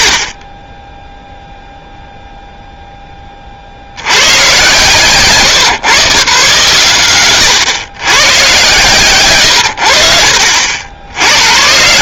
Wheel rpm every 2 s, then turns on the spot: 20, 0, 150, 130, 160, 70.
none